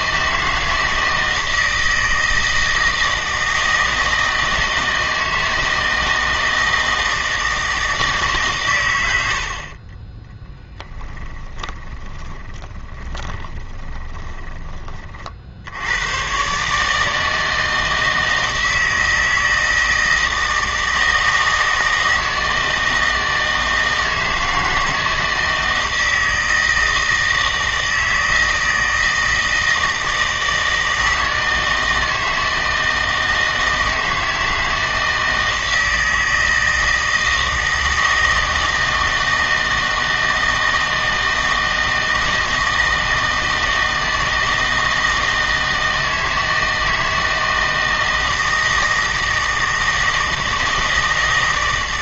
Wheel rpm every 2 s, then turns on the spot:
160, 160, 160, 160, 130, 10, 20, 30, 150, 160, 160, 160, 160, 160, 160, 160, 160, 160, 160, 160, 160, 160, 160, 160, 160, 160.
10-14